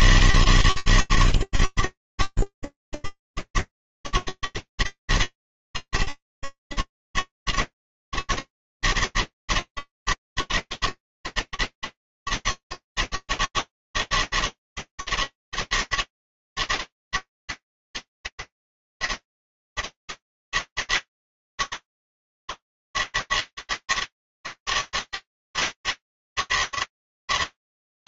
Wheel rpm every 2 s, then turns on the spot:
160, 80, 160, 110, 160, 160, 160, 160, 160, 160, 160, 160, 160, 160.
none